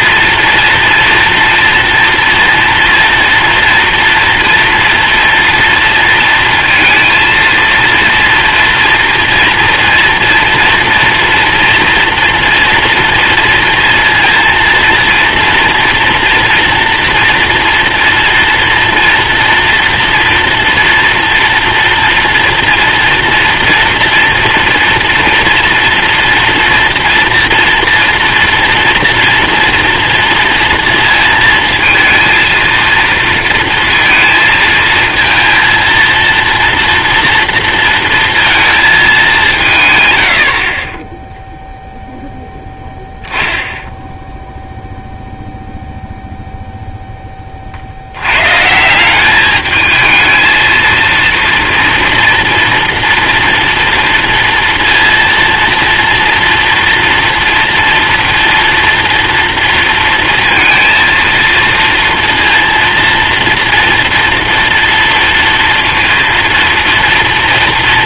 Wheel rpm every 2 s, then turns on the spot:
240, 240, 230, 230, 230, 230, 230, 230, 230, 230, 230, 230, 230, 230, 240, 230, 230, 230, 230, 220, 30, 10, 0, 0, 140, 230, 230, 230, 230, 230, 230, 230, 230, 230.
none